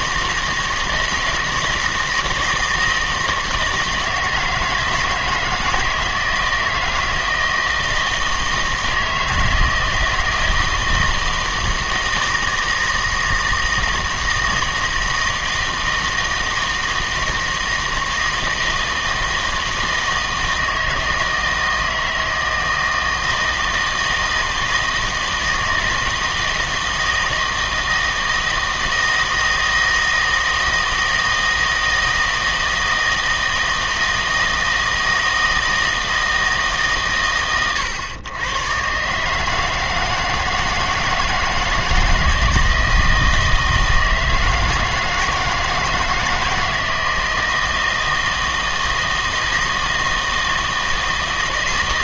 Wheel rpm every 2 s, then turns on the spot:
160, 160, 160, 160, 160, 160, 160, 160, 160, 160, 160, 160, 160, 160, 160, 160, 160, 160, 140, 120, 160, 160, 160, 160, 160, 160.
none